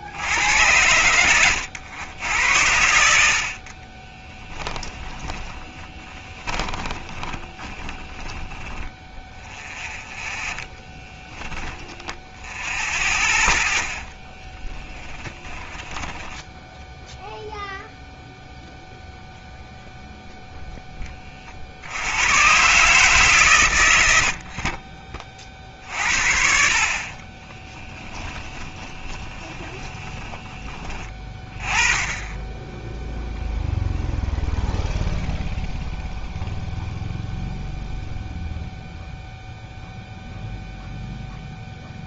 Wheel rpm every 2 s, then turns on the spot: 90, 90, 20, 20, 10, 10, 0, 10, 0, 0, 10, 140, 30, 50, 20, 30, 0, 0, 0, 0, 0.
4-10 14-16 28-30